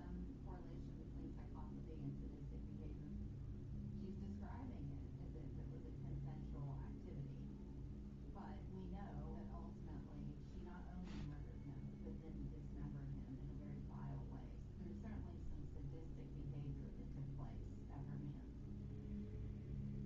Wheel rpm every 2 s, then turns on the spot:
0, 0, 0, 0, 0, 0, 0, 0, 0, 0.
none